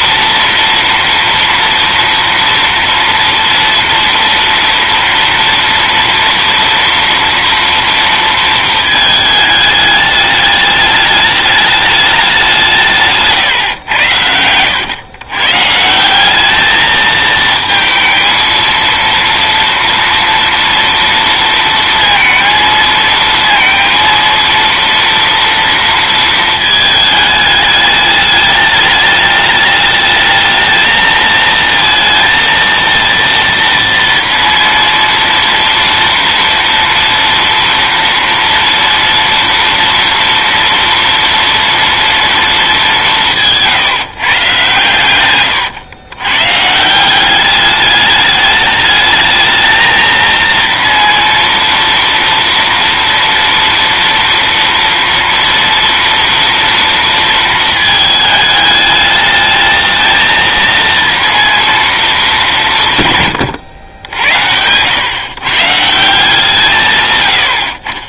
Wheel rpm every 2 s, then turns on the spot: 230, 230, 230, 230, 220, 210, 160, 110, 220, 230, 230, 220, 230, 220, 210, 220, 230, 230, 230, 230, 230, 200, 130, 160, 210, 230, 230, 230, 230, 210, 230, 160, 110, 150.
none